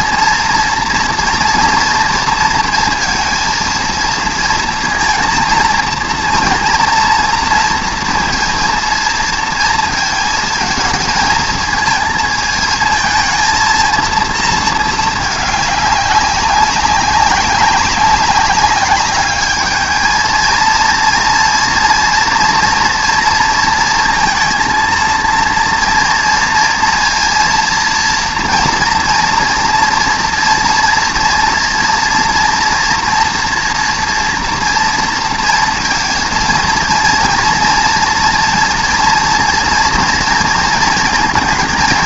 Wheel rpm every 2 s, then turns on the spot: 230, 230, 230, 230, 230, 220, 220, 220, 190, 200, 230, 230, 230, 230, 230, 230, 230, 230, 230, 240, 230.
none